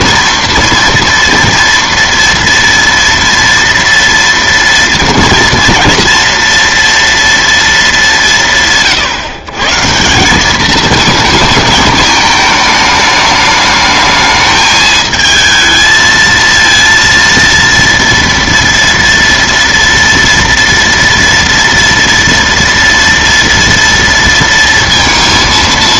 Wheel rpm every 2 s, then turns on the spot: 230, 230, 230, 230, 150, 220, 220, 220, 230, 230, 230, 230, 230.
none